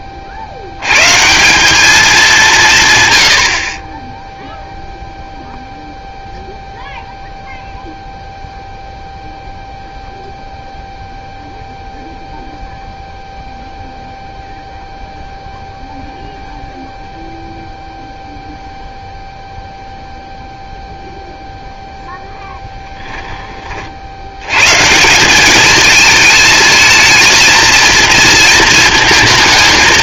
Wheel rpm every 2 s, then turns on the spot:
100, 140, 0, 0, 0, 0, 0, 0, 0, 0, 0, 10, 130, 220, 220.
none